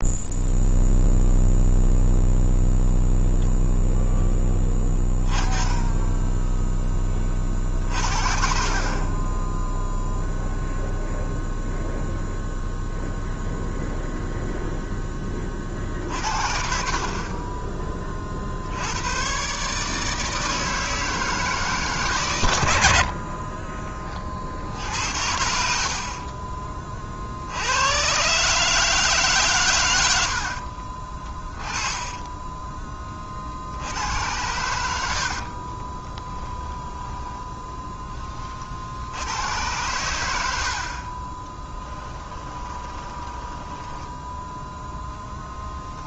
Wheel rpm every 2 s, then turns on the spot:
0, 0, 10, 10, 50, 0, 0, 0, 50, 70, 160, 90, 60, 30, 150, 50, 20, 80, 10, 50, 60, 20, 10.
30-32 36-38 42-44